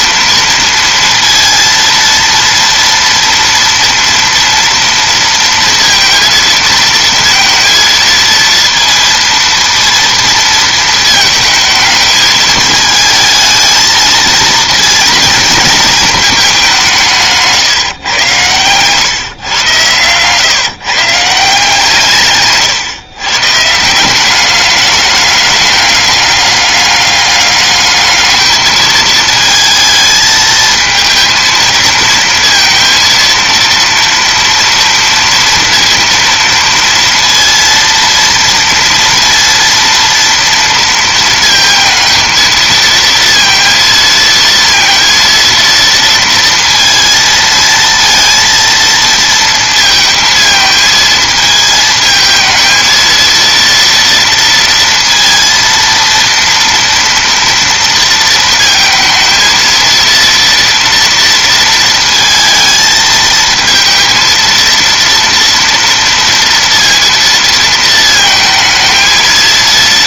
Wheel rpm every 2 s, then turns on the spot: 230, 230, 230, 230, 230, 230, 220, 230, 200, 110, 140, 130, 200, 200, 220, 220, 230, 230, 230, 230, 230, 230, 230, 230, 230, 220, 220, 230, 230, 230, 230, 220, 230, 230, 220.
18-20